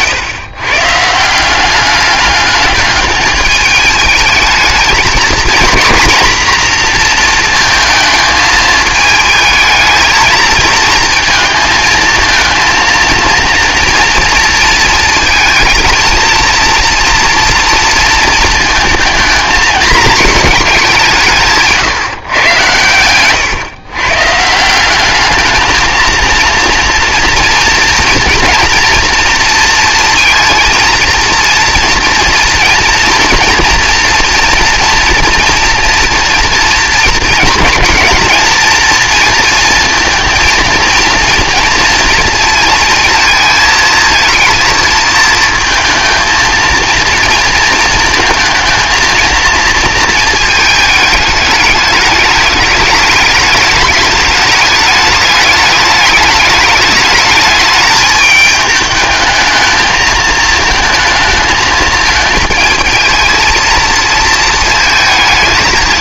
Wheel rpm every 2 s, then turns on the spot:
140, 210, 220, 240, 220, 230, 230, 230, 230, 220, 220, 120, 170, 230, 240, 230, 230, 230, 230, 220, 230, 230, 230, 230, 230, 220, 210, 210, 210, 210, 220, 220, 220.
none